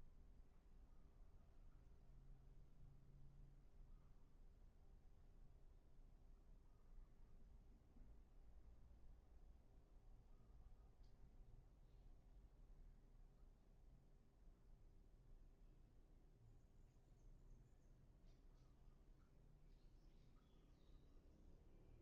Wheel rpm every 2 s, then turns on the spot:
0, 0, 0, 0, 0, 0, 0, 0, 0, 0, 0.
none